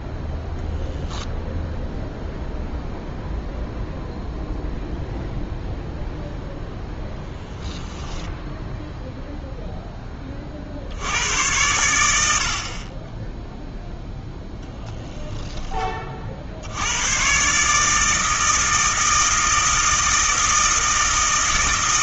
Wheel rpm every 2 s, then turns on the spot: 0, 0, 0, 0, 0, 50, 50, 0, 80, 160, 160.
none